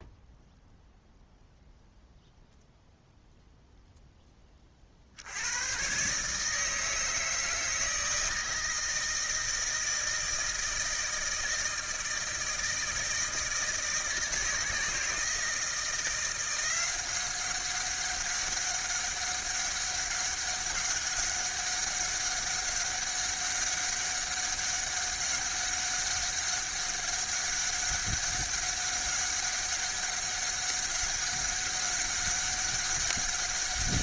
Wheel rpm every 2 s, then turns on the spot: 0, 0, 30, 150, 160, 160, 160, 160, 180, 200, 200, 200, 200, 200, 200, 200, 200.
none